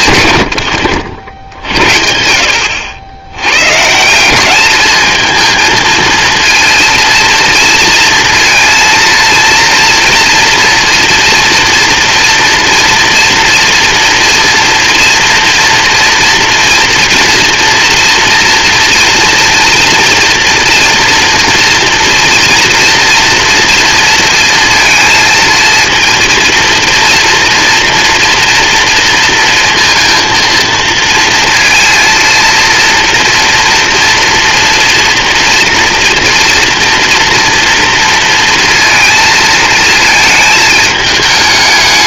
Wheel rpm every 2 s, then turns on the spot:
60, 90, 220, 230, 230, 240, 240, 230, 230, 240, 230, 240, 230, 230, 230, 230, 230, 230, 230, 230, 210.
none